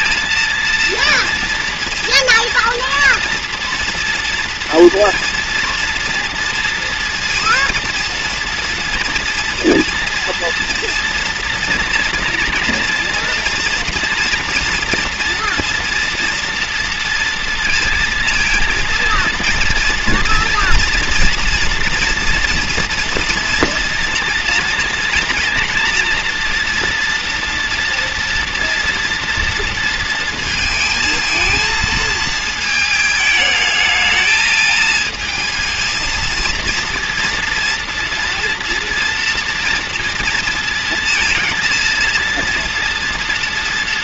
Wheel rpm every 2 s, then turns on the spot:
230, 240, 230, 230, 230, 240, 240, 230, 230, 230, 230, 230, 240, 230, 230, 220, 220, 220, 230, 230, 230, 230.
none